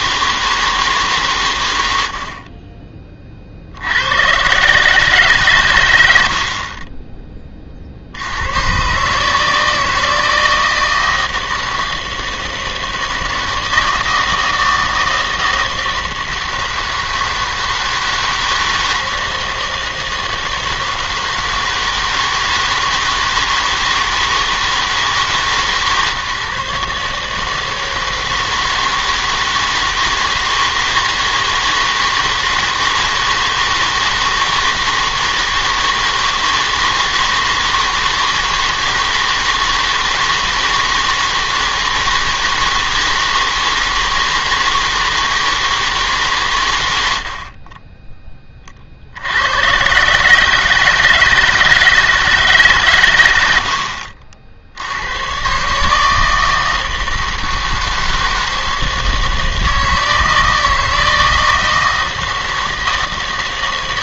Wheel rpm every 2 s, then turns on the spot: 160, 40, 130, 50, 110, 160, 160, 160, 160, 160, 160, 160, 160, 150, 160, 160, 160, 160, 160, 160, 160, 160, 160, 110, 30, 150, 150, 70, 160, 160, 160, 160.
none